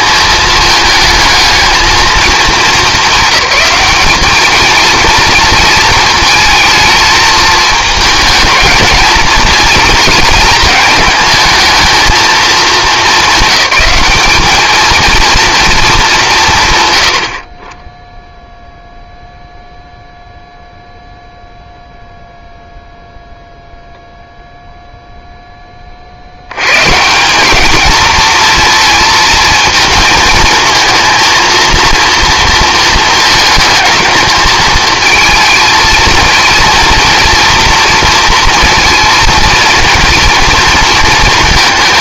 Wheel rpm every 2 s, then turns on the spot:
220, 210, 220, 220, 220, 220, 210, 210, 140, 0, 0, 0, 0, 110, 230, 230, 230, 220, 230, 230, 230.
none